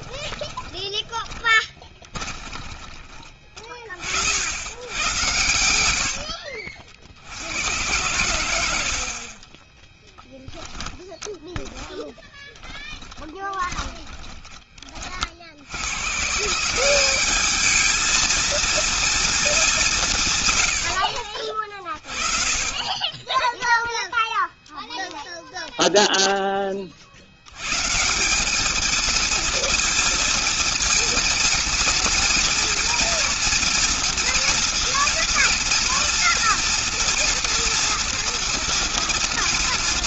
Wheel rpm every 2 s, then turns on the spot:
20, 20, 90, 50, 70, 10, 10, 40, 180, 230, 100, 30, 0, 50, 220, 230, 240, 230, 230, 230.
0-2 10-14